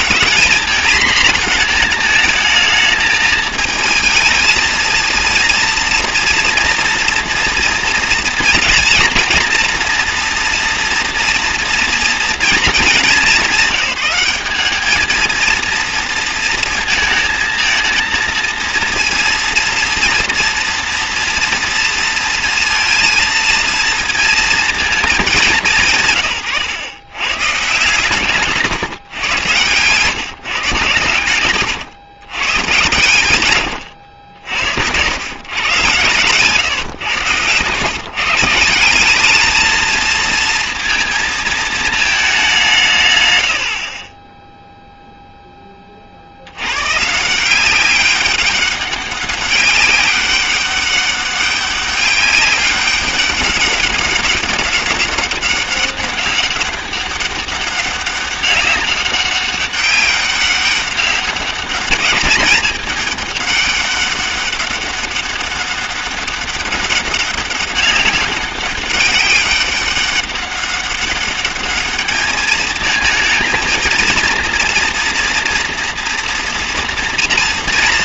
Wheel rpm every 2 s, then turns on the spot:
230, 220, 220, 230, 230, 230, 220, 200, 230, 230, 230, 230, 230, 120, 150, 130, 120, 80, 130, 170, 230, 180, 0, 90, 200, 200, 200, 200, 200, 200, 190, 210, 200, 200, 200, 200, 220, 230, 240.
28-30